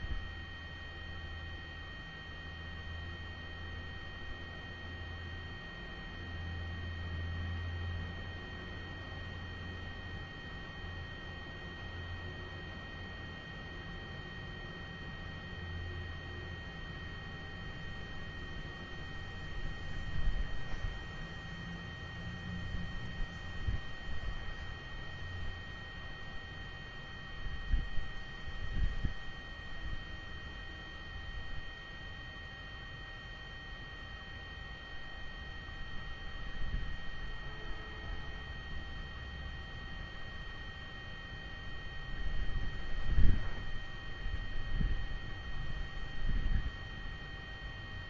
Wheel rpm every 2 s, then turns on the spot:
0, 0, 0, 0, 0, 0, 0, 0, 0, 0, 0, 0, 0, 0, 0, 0, 0, 0, 0, 0, 0, 0, 0, 0.
none